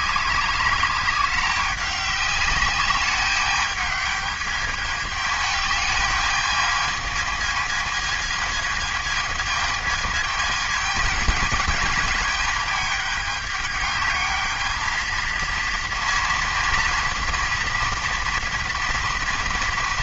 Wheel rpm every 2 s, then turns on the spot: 200, 200, 210, 220, 220, 220, 220, 220, 230, 230.
none